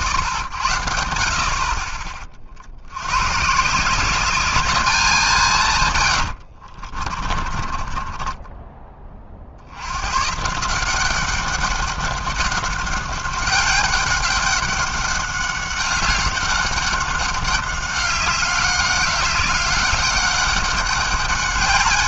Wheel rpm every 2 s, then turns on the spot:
70, 70, 200, 60, 10, 160, 190, 190, 190, 200, 200.
6-10